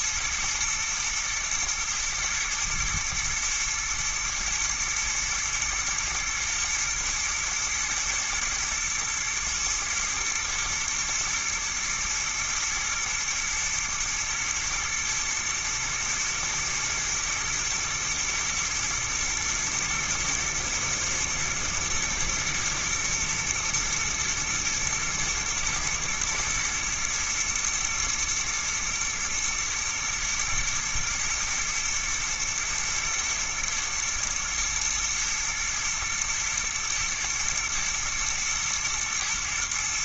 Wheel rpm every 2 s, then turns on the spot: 120, 120, 120, 120, 110, 120, 110, 110, 110, 120, 120, 120, 110, 110, 120, 110, 120, 120, 120, 120.
none